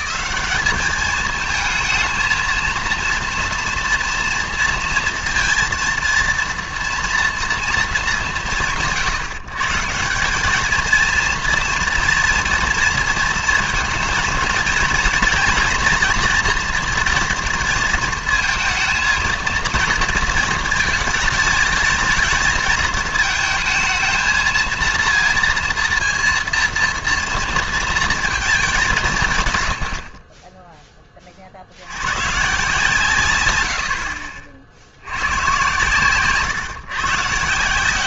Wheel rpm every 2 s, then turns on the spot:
210, 230, 240, 230, 140, 220, 230, 230, 230, 230, 230, 220, 230, 230, 210, 10, 130, 70, 130.
none